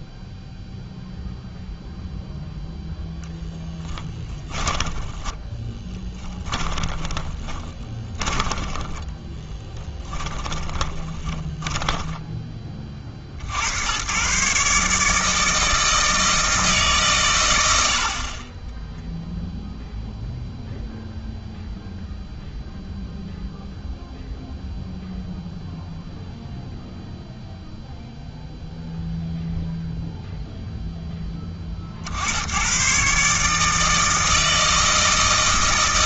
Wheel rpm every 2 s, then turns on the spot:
0, 0, 20, 20, 20, 20, 30, 150, 160, 10, 0, 0, 0, 0, 0, 0, 100, 160.
4-12 18-20